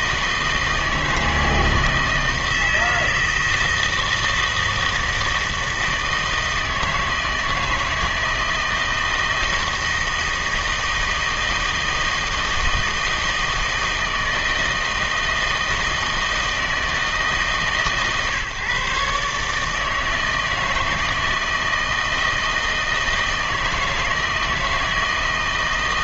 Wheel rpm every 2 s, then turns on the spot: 160, 160, 160, 160, 160, 160, 160, 160, 160, 140, 160, 160, 160.
none